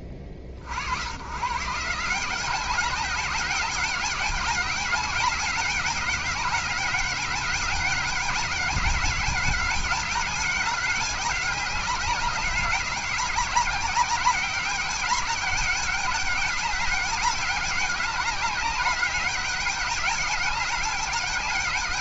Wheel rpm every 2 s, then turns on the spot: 50, 190, 200, 190, 200, 200, 190, 190, 200, 190, 200.
none